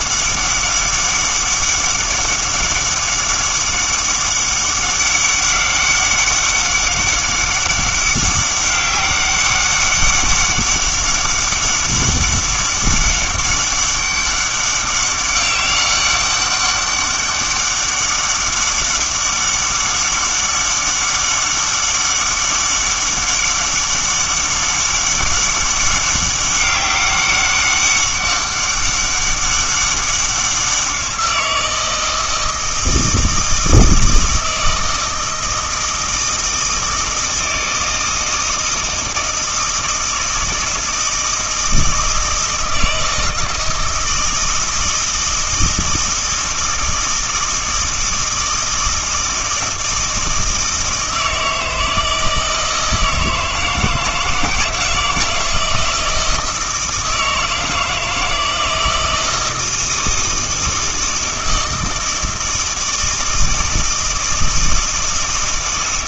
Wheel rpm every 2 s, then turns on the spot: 200, 200, 200, 200, 200, 200, 200, 200, 200, 200, 200, 200, 200, 200, 200, 190, 160, 160, 160, 160, 160, 160, 160, 160, 160, 160, 160, 160, 160, 160, 160, 160, 160.
none